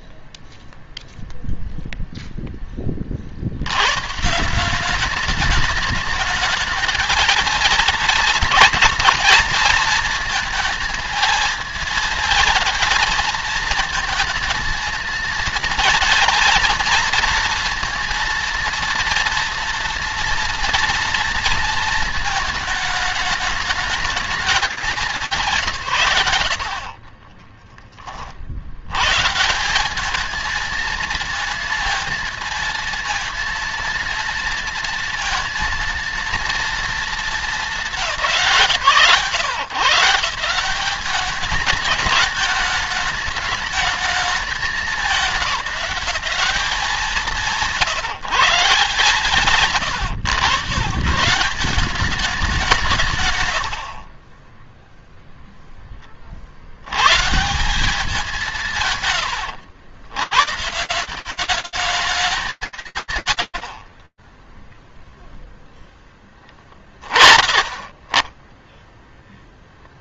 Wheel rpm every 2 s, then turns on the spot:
10, 0, 150, 220, 230, 230, 220, 220, 230, 230, 230, 220, 200, 80, 100, 220, 230, 230, 230, 140, 180, 220, 210, 170, 140, 130, 170, 10, 60, 150, 160, 30, 20, 30, 0.
none